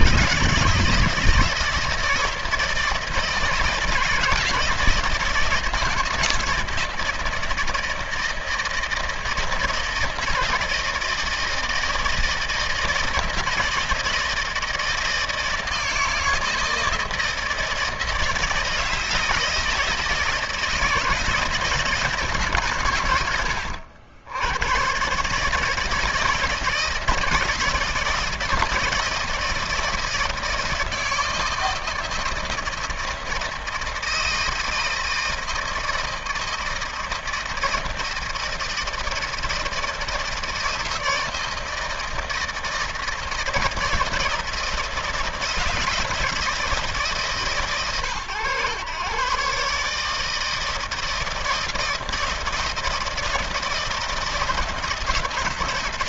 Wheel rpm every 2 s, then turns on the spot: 160, 160, 160, 160, 160, 160, 160, 160, 160, 160, 160, 140, 90, 160, 160, 160, 160, 160, 160, 160, 160, 160, 160, 160, 110, 160, 160, 160.
none